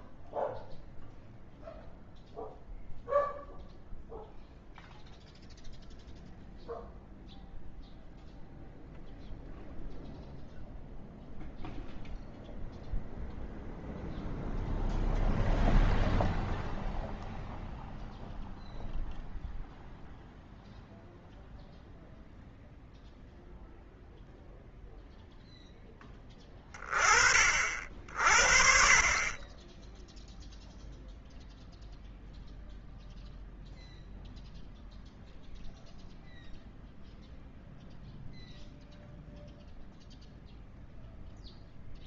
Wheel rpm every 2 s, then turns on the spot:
0, 0, 0, 0, 0, 0, 0, 0, 0, 0, 0, 0, 0, 30, 40, 0, 0, 0, 0, 0, 0.
none